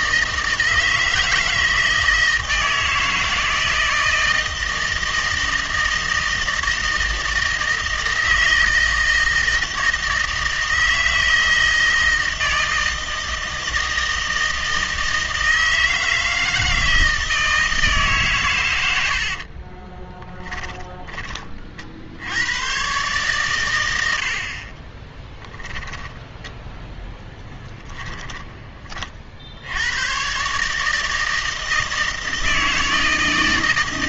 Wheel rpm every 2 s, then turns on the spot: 160, 160, 160, 160, 160, 160, 160, 160, 160, 90, 20, 130, 20, 0, 30, 150, 160.
18-22 24-26